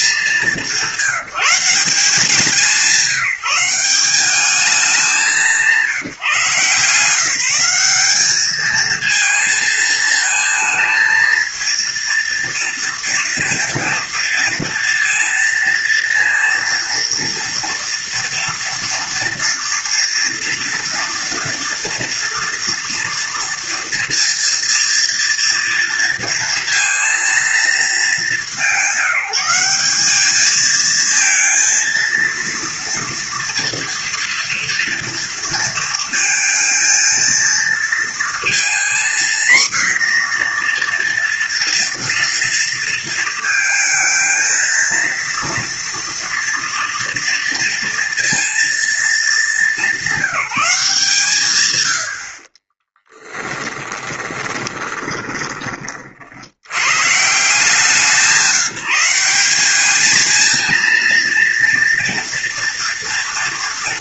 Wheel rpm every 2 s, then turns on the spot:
190, 160, 200, 150, 210, 220, 230, 230, 230, 230, 230, 230, 230, 230, 190, 220, 230, 230, 230, 240, 240, 230, 220, 240, 230, 160, 20, 20, 90, 170, 230, 220.
52-56